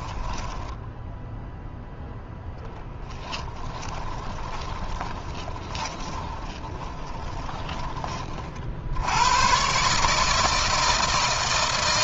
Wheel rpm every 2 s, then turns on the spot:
10, 10, 20, 10, 70, 160.
2-8